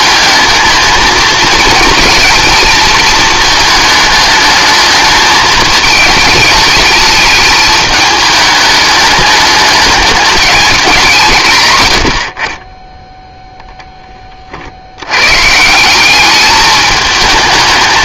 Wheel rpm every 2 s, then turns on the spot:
220, 230, 220, 220, 210, 190, 30, 50, 210.
none